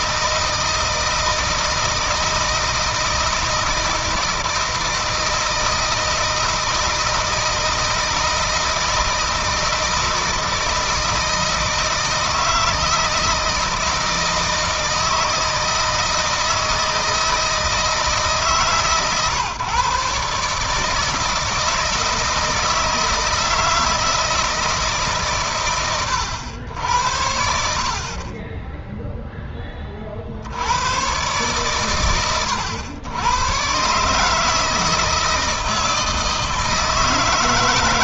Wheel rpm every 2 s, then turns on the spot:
160, 160, 160, 160, 160, 160, 160, 160, 160, 140, 160, 160, 150, 80, 10, 100, 110, 160, 160.
none